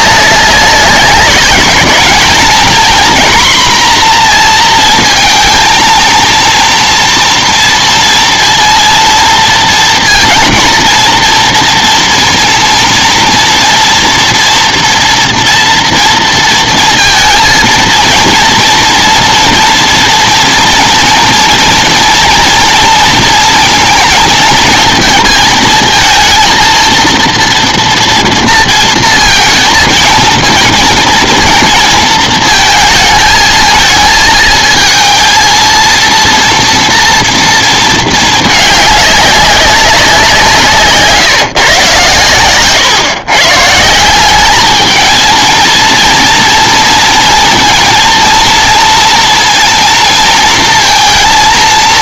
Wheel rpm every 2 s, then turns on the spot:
190, 230, 230, 230, 230, 230, 230, 240, 230, 230, 230, 230, 230, 230, 230, 220, 220, 220, 230, 210, 160, 140, 210, 240, 230, 230.
none